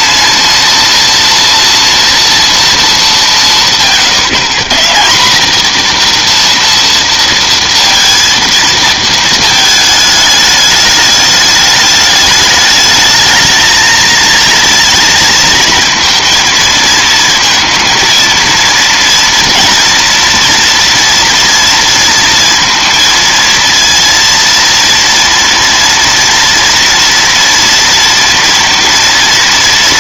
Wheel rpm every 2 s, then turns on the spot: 230, 150, 230, 230, 220, 210, 220, 230, 230, 230, 230, 230, 230, 230, 230.
none